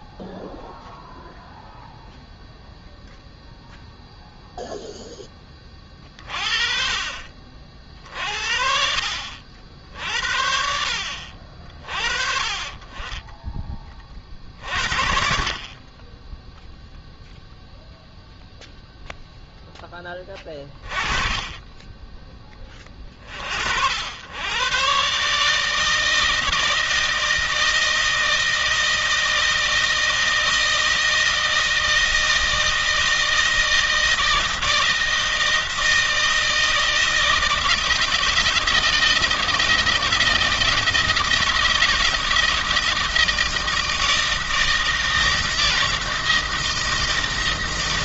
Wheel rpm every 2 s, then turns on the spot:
0, 0, 0, 30, 50, 60, 50, 40, 10, 0, 20, 20, 110, 160, 160, 160, 160, 160, 160, 160, 160, 160, 160, 160.
none